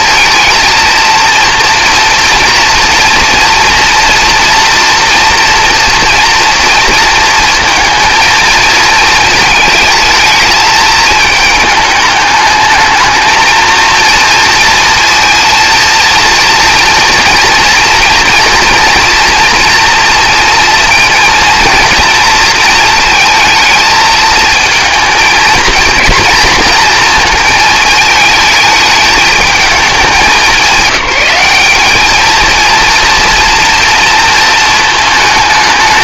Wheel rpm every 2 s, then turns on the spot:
230, 230, 230, 230, 220, 220, 210, 230, 230, 230, 230, 230, 220, 230, 220, 190, 230, 220.
none